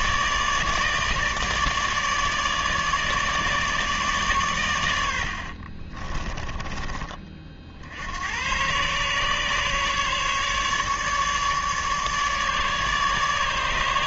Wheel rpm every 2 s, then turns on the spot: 150, 150, 90, 30, 130, 150, 150.
none